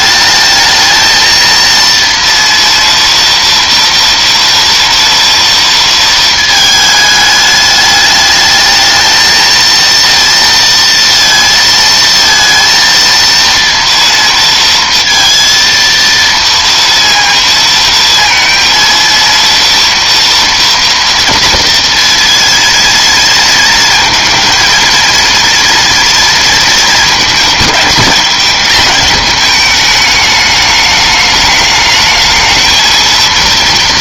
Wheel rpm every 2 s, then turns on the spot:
220, 230, 230, 220, 220, 230, 230, 230, 230, 230, 230, 230, 230, 230, 220, 210, 220.
none